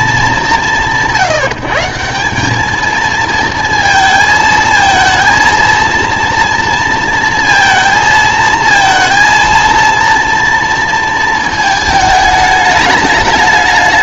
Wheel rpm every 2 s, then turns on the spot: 190, 210, 220, 230, 230, 230, 210.
none